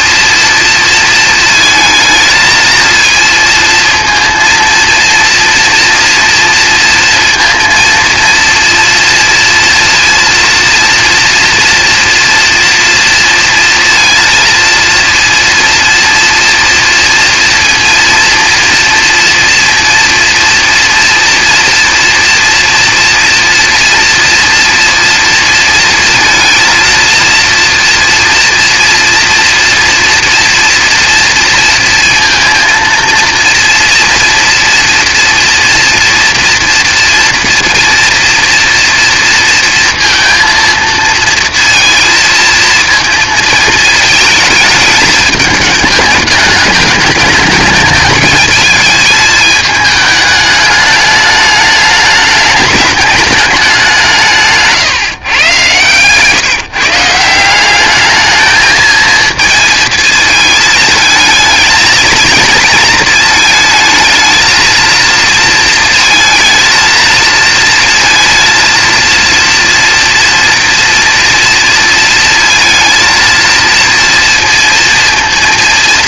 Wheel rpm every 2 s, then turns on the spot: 230, 230, 230, 230, 230, 230, 230, 230, 230, 230, 230, 230, 230, 230, 230, 230, 230, 230, 240, 240, 230, 230, 220, 210, 220, 210, 210, 150, 150, 220, 220, 230, 230, 230, 230, 230, 230, 230.
none